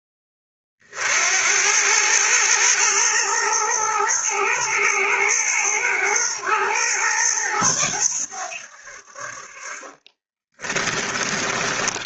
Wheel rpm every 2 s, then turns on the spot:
30, 110, 110, 110, 80, 20.
10-12